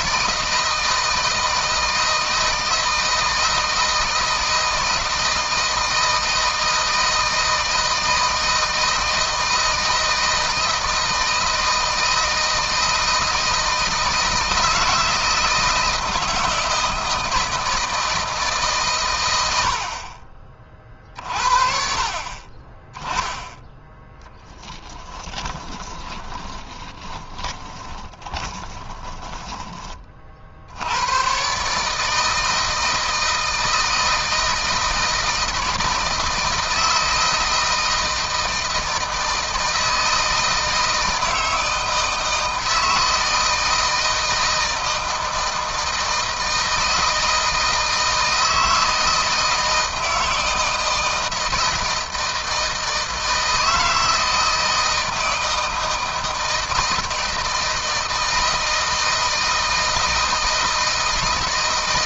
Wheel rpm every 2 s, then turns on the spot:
160, 160, 160, 160, 160, 160, 160, 160, 160, 130, 50, 30, 10, 20, 20, 90, 160, 160, 170, 160, 160, 160, 160, 160, 160, 160, 160, 160, 160, 160, 160.
24-30